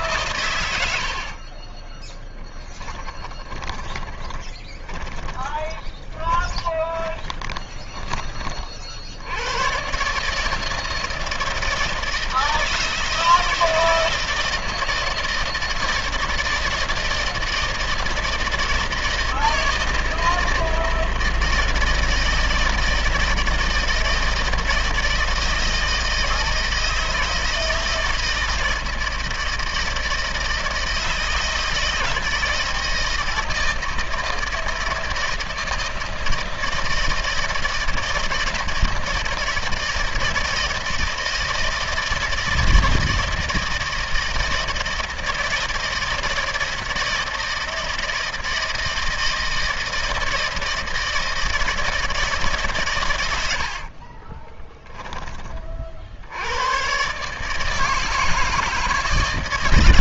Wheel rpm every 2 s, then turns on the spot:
120, 10, 10, 20, 30, 150, 160, 160, 170, 160, 160, 160, 160, 160, 160, 160, 160, 160, 160, 160, 160, 160, 160, 160, 160, 160, 150, 30, 90, 160.
4-8 54-56